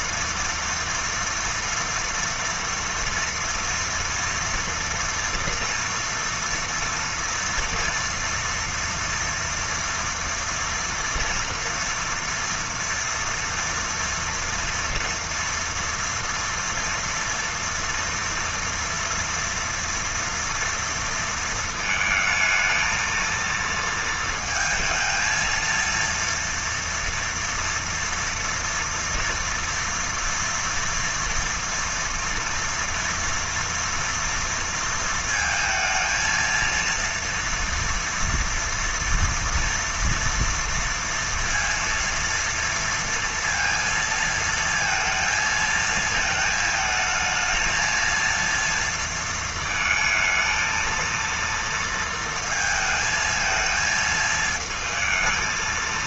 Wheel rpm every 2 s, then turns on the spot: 230, 230, 230, 230, 230, 230, 240, 230, 230, 230, 230, 220, 230, 230, 230, 230, 230, 230, 230, 230, 230, 230, 230, 220, 230, 230, 230, 220.
none